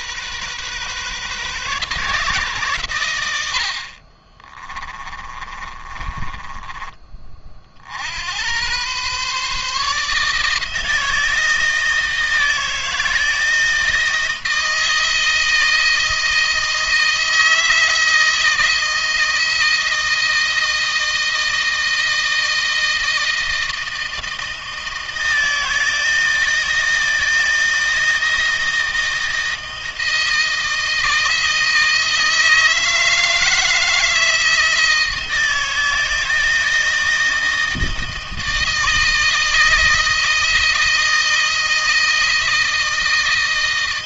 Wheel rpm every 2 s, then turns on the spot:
130, 120, 20, 30, 110, 160, 160, 160, 160, 160, 160, 160, 160, 160, 160, 160, 160, 160, 160, 160, 160, 160.
4-6